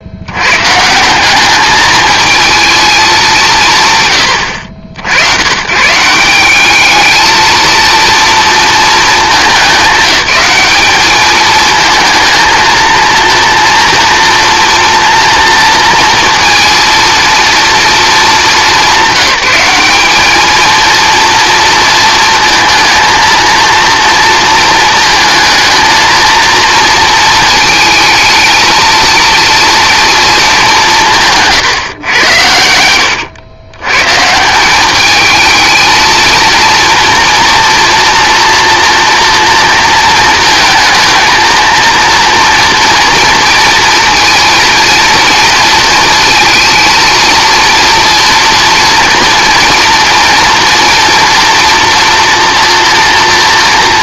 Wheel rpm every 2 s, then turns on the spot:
160, 210, 70, 210, 220, 210, 230, 230, 230, 200, 230, 230, 220, 230, 230, 170, 90, 200, 230, 240, 230, 230, 230, 230, 230, 230, 230.
32-34